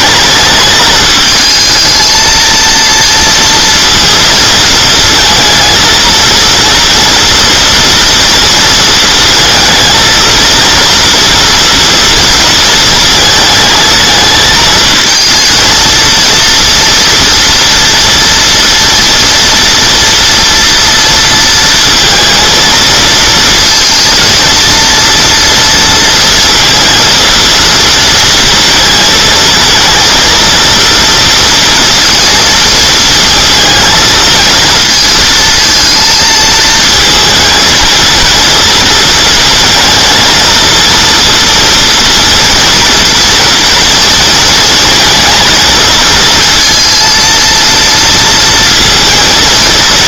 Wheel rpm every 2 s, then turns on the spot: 220, 230, 230, 230, 230, 230, 220, 220, 230, 230, 230, 220, 230, 230, 220, 230, 230, 230, 230, 230, 230, 230, 230, 230, 230.
none